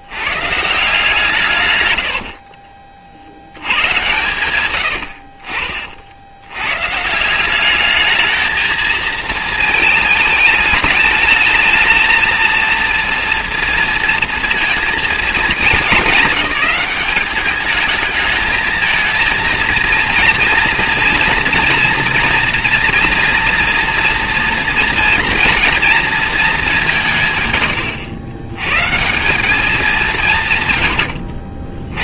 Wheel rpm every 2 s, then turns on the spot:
160, 50, 80, 150, 220, 210, 230, 230, 210, 230, 230, 240, 230, 160, 170, 80.
none